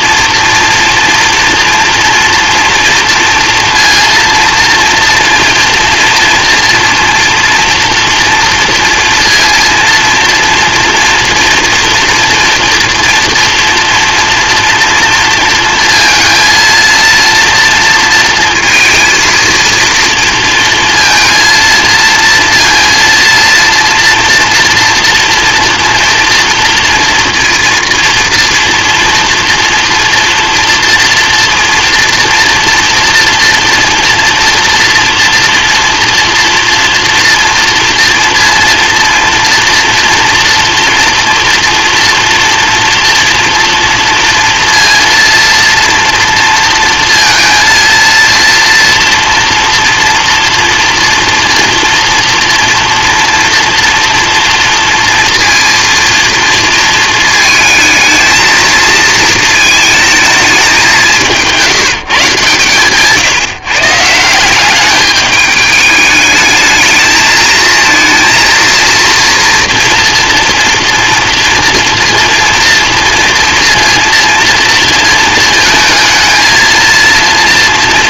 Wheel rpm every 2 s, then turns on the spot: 230, 240, 230, 230, 230, 230, 230, 230, 230, 230, 230, 230, 230, 230, 240, 240, 230, 230, 230, 240, 230, 230, 230, 230, 230, 230, 240, 230, 220, 230, 190, 140, 200, 220, 230, 230, 230, 230, 230.
none